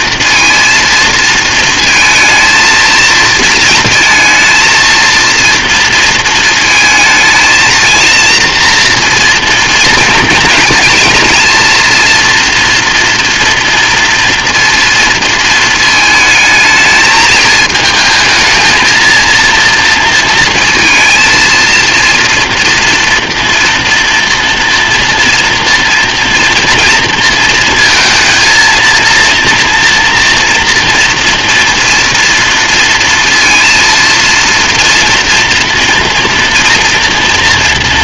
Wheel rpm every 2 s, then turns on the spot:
230, 230, 230, 230, 230, 230, 230, 240, 220, 220, 230, 230, 240, 230, 220, 240, 230, 230, 230.
none